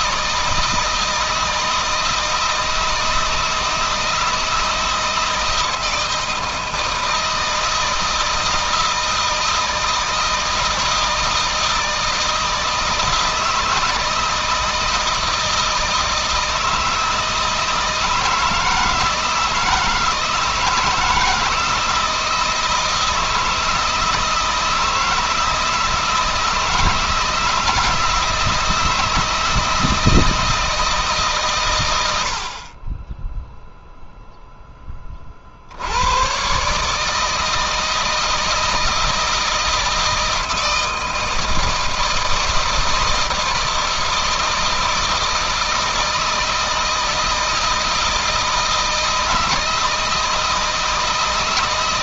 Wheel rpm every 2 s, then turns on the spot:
160, 160, 160, 160, 160, 160, 160, 160, 160, 160, 160, 160, 160, 160, 160, 150, 20, 20, 150, 160, 160, 160, 160, 160, 160, 160.
none